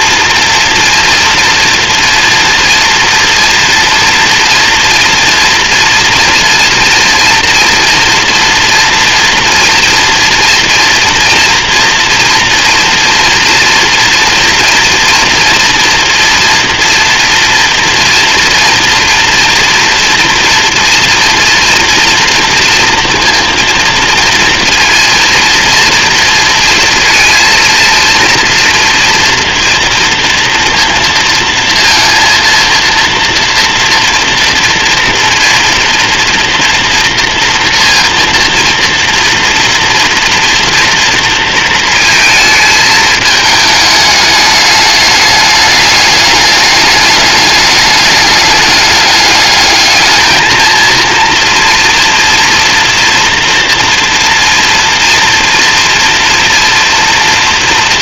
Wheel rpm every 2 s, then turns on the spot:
230, 240, 230, 240, 230, 230, 240, 230, 230, 230, 230, 230, 230, 230, 230, 230, 230, 230, 240, 230, 230, 220, 210, 210, 210, 220, 240, 230, 230.
none